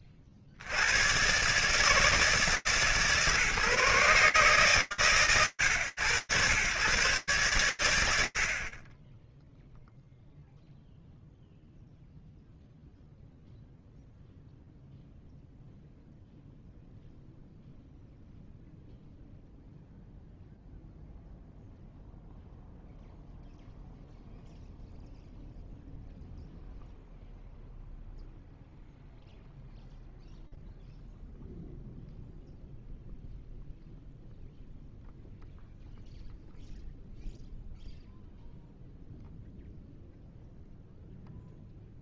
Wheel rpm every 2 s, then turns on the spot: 50, 160, 140, 110, 60, 0, 0, 0, 0, 0, 0, 0, 0, 0, 0, 0, 0, 0, 0, 0, 0.
none